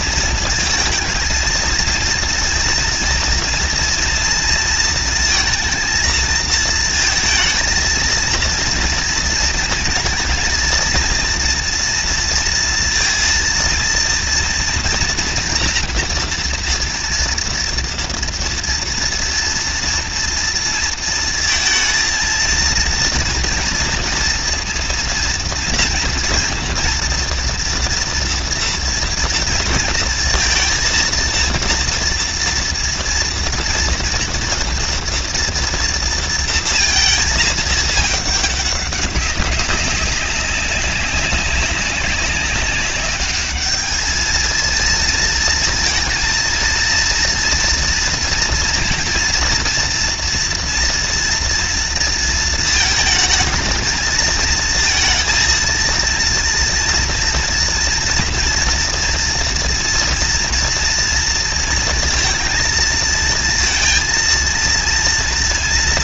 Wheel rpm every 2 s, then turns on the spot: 230, 230, 230, 220, 230, 230, 230, 230, 230, 230, 230, 230, 230, 240, 240, 230, 240, 240, 230, 210, 190, 200, 220, 230, 230, 230, 230, 220, 230, 240, 230, 230, 230.
none